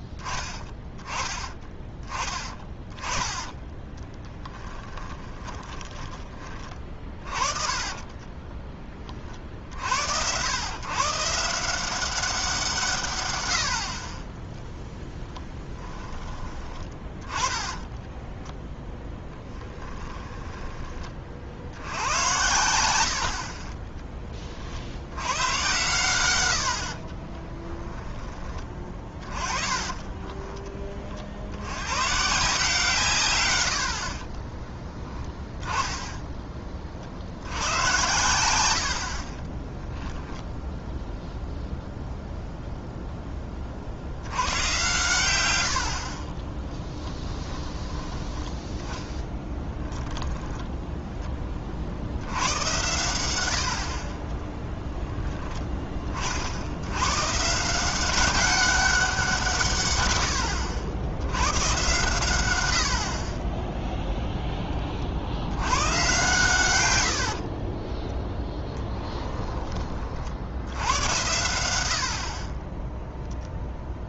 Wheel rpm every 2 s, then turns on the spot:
10, 20, 20, 40, 20, 120, 170, 0, 20, 10, 20, 90, 50, 80, 20, 30, 150, 10, 20, 90, 10, 0, 100, 20, 20, 10, 100, 10, 70, 190, 80, 90, 20, 110, 10, 70, 30.
2-6 18-22 30-32 34-36 54-56 68-70